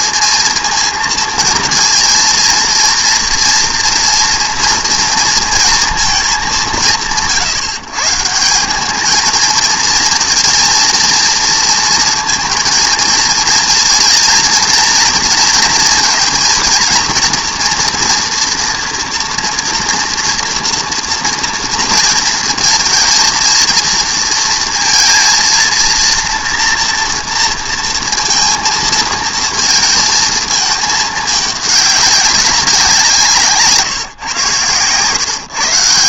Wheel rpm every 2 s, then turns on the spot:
230, 230, 230, 170, 200, 220, 220, 230, 230, 230, 240, 230, 230, 230, 230, 220, 190, 120.
none